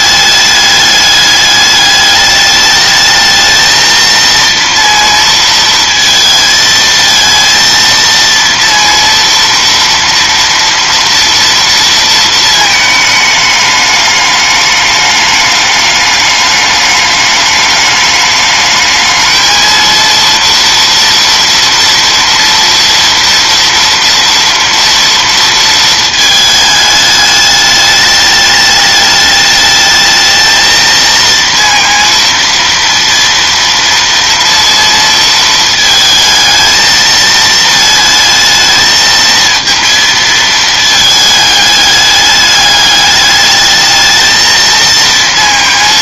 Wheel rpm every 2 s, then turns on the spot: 210, 210, 230, 220, 230, 230, 220, 210, 210, 220, 230, 230, 230, 210, 210, 230, 230, 230, 220, 220, 220, 210, 230.
none